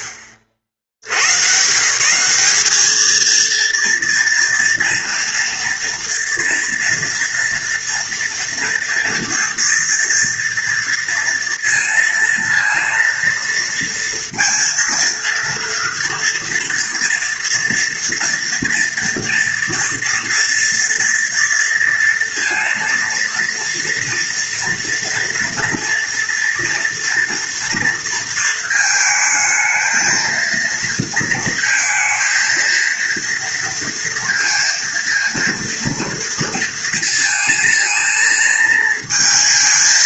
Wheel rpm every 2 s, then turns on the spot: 60, 220, 240, 230, 230, 230, 230, 230, 230, 230, 230, 230, 230, 230, 220, 230, 230, 230, 230, 230.
none